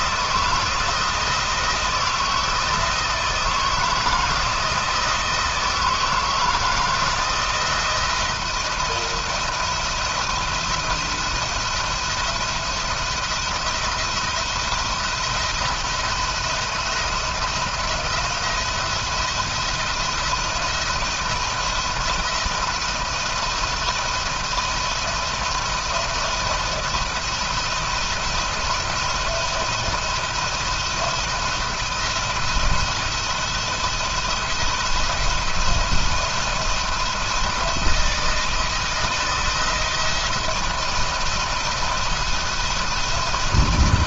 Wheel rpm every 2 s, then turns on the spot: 170, 160, 160, 160, 170, 170, 170, 170, 170, 170, 170, 170, 160, 170, 170, 170, 170, 170, 170, 170, 170, 170.
none